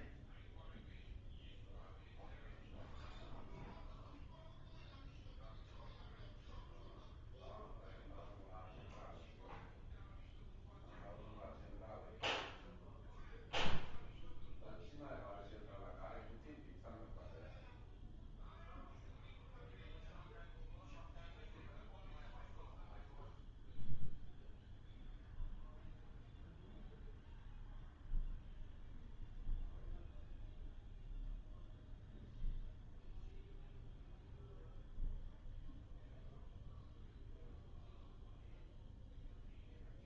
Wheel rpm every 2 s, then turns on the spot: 0, 0, 0, 0, 0, 0, 0, 0, 0, 0, 0, 0, 0, 0, 0, 0, 0, 0, 0, 0.
none